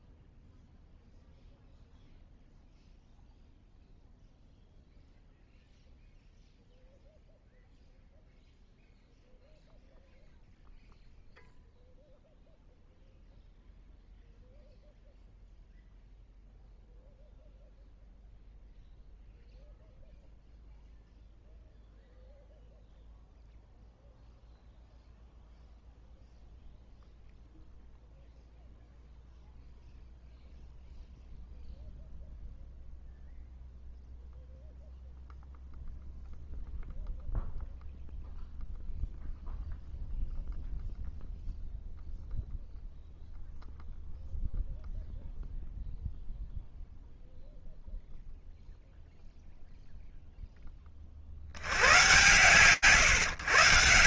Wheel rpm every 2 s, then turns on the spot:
0, 0, 0, 0, 0, 0, 0, 0, 0, 0, 0, 0, 0, 0, 0, 0, 0, 0, 0, 0, 0, 0, 0, 0, 0, 0, 120.
none